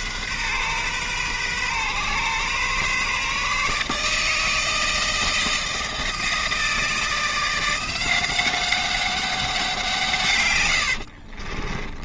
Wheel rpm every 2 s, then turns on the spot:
130, 140, 160, 160, 190, 100.
10-12